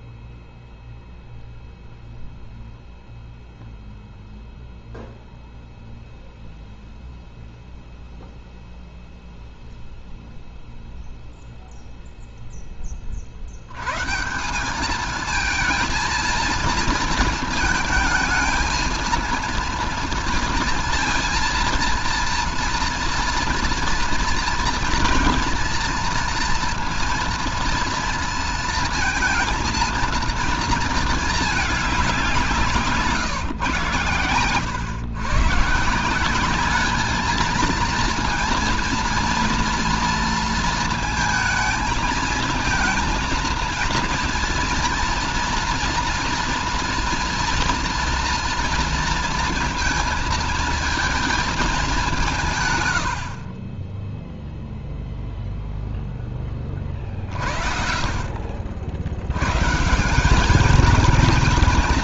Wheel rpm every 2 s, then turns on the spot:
0, 0, 0, 0, 0, 0, 10, 180, 230, 230, 230, 240, 230, 230, 230, 230, 180, 110, 200, 230, 230, 230, 240, 230, 230, 230, 150, 0, 20, 50, 200.
none